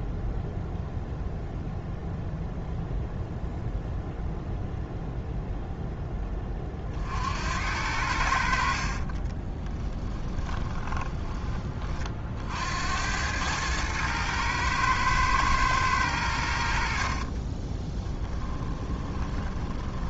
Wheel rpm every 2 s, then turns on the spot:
0, 0, 0, 50, 50, 10, 80, 110, 60, 20.
8-12 18-20